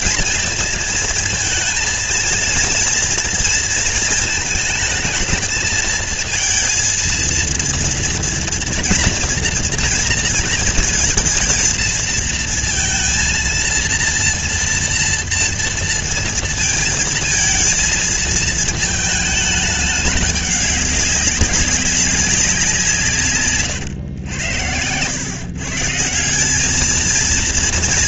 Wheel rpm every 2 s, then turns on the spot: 230, 230, 220, 220, 230, 230, 230, 230, 230, 230, 210, 190, 100, 170.
none